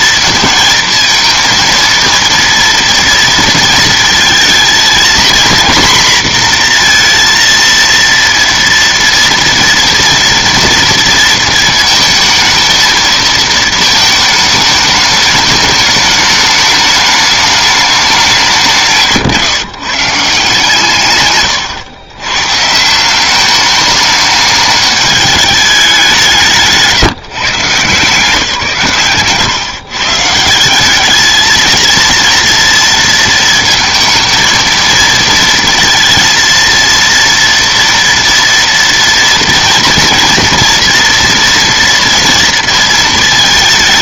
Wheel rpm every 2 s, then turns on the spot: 230, 230, 230, 240, 230, 230, 220, 220, 210, 180, 150, 140, 210, 170, 160, 170, 230, 220, 230, 240, 240, 230.
none